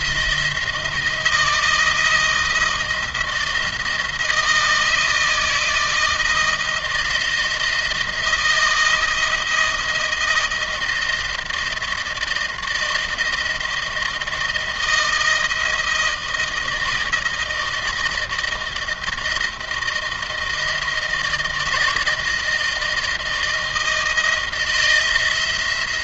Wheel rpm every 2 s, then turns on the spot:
160, 170, 160, 160, 160, 160, 160, 160, 160, 160, 170, 160, 170.
none